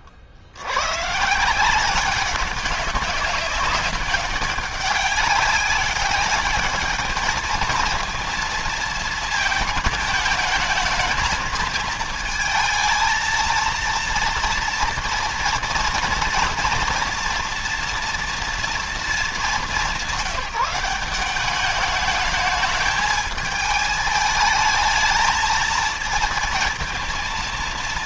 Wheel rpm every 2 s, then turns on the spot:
70, 190, 200, 200, 230, 220, 220, 240, 230, 230, 180, 210, 220, 220.
none